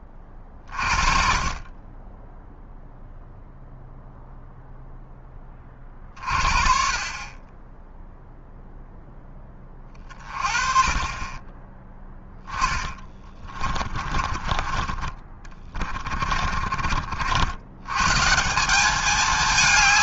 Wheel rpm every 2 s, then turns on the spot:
30, 0, 0, 40, 0, 30, 20, 50, 40, 200.
12-14